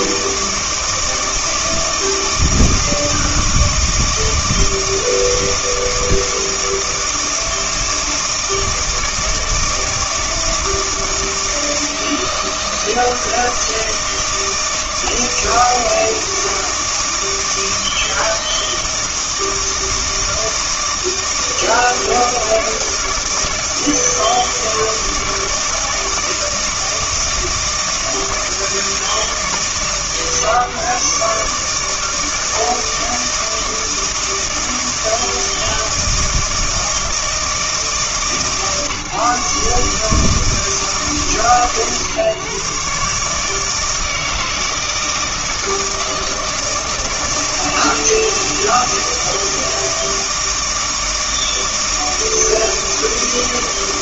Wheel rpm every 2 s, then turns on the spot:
160, 160, 160, 160, 160, 160, 160, 160, 160, 160, 160, 160, 160, 160, 160, 150, 160, 160, 160, 150, 160, 130, 160, 160, 160, 160, 160.
none